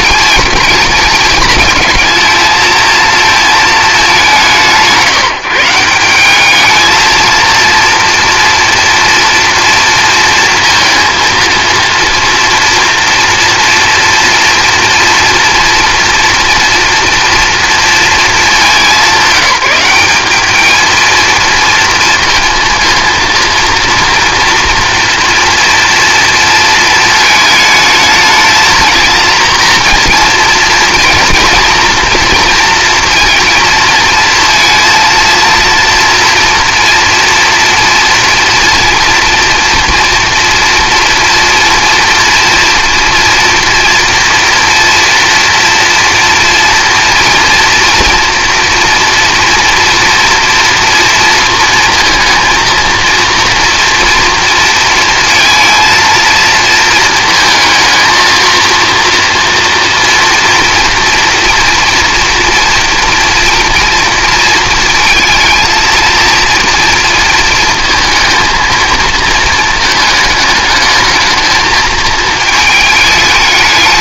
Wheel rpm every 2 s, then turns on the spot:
210, 230, 170, 220, 230, 230, 230, 230, 230, 200, 220, 230, 230, 230, 230, 230, 230, 230, 240, 240, 240, 240, 230, 230, 230, 230, 230, 220, 220, 230, 230, 230, 230, 230, 220, 210, 210.
none